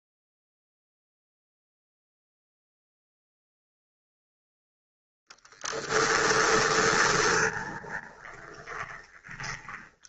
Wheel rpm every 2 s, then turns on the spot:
0, 0, 0, 20, 20.
6-10